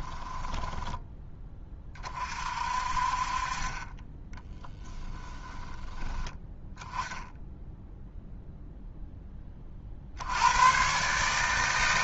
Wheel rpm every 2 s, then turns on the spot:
10, 40, 20, 10, 0, 120.
0-2 4-6